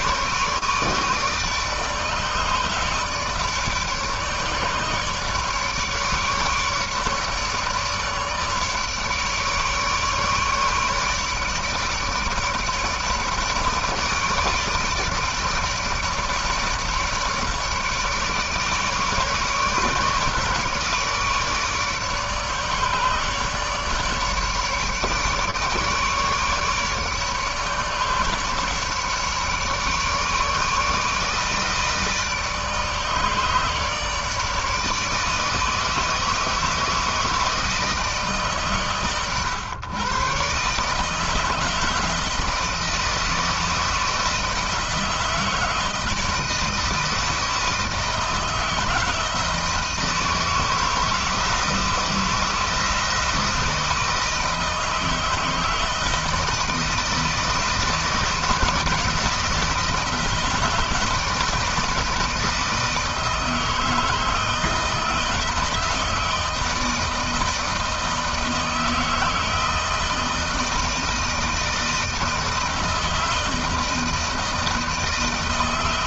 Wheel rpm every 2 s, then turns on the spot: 150, 150, 150, 150, 150, 150, 150, 150, 150, 150, 150, 150, 150, 150, 150, 150, 150, 150, 160, 130, 150, 160, 160, 160, 160, 160, 160, 160, 160, 160, 160, 160, 160, 160, 160, 160, 160, 160.
none